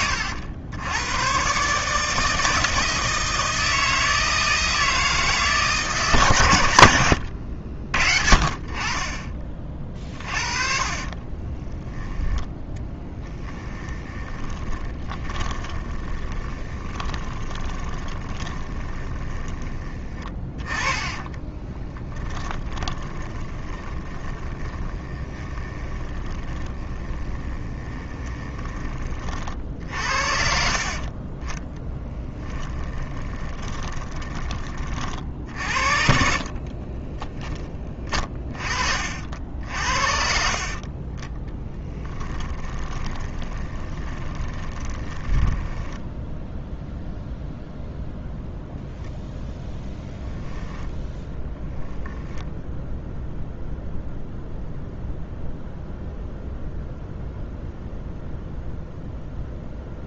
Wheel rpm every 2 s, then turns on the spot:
90, 160, 160, 100, 30, 40, 10, 20, 20, 30, 30, 20, 20, 20, 20, 50, 20, 40, 20, 40, 40, 20, 20, 0, 0, 0, 0, 0, 0, 0.
10-20 22-28 30-34 36-38 40-46